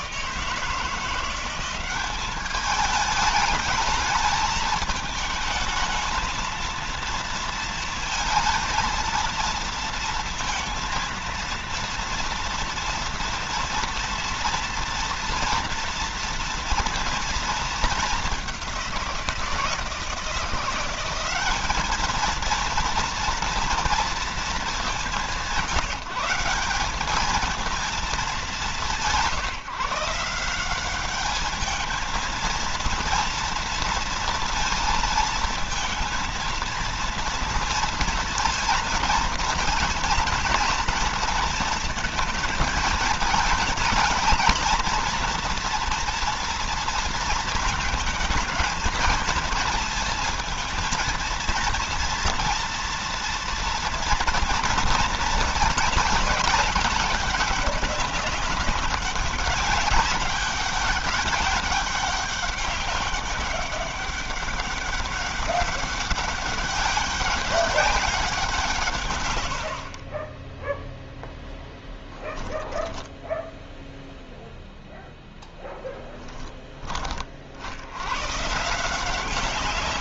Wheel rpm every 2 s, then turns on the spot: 170, 210, 220, 230, 230, 230, 230, 230, 230, 180, 190, 240, 200, 200, 180, 200, 230, 230, 230, 230, 230, 220, 230, 230, 220, 230, 230, 230, 200, 190, 200, 200, 200, 200, 140, 0, 10, 0, 30, 170.
none